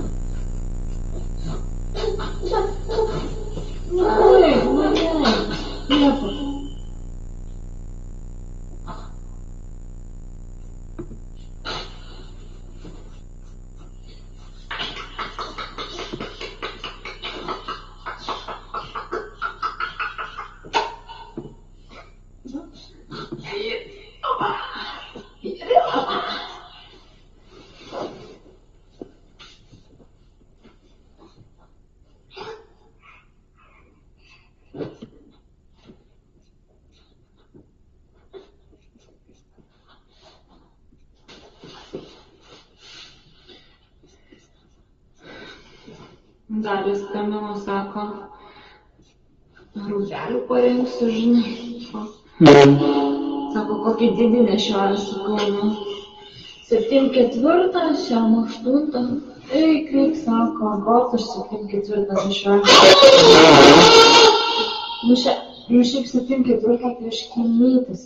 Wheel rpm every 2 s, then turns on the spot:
0, 0, 0, 0, 0, 0, 0, 0, 0, 0, 0, 0, 0, 0, 0, 0, 0, 0, 0, 0, 0, 0, 0, 0, 0, 0, 0, 0, 0, 0, 0, 0, 0, 0.
none